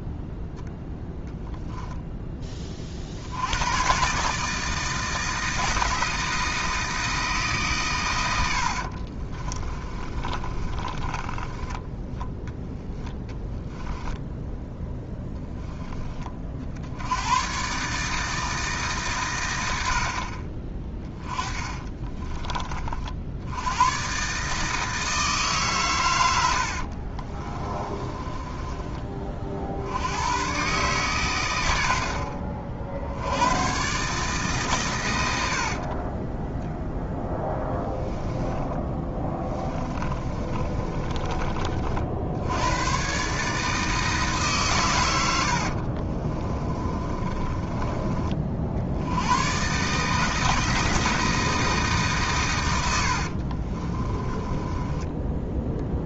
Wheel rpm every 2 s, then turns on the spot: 0, 40, 160, 160, 70, 30, 10, 0, 70, 150, 20, 40, 160, 70, 20, 130, 70, 130, 10, 20, 30, 100, 120, 20, 60, 160, 90, 20.
8-12 20-22 26-28 38-42 46-48 54-56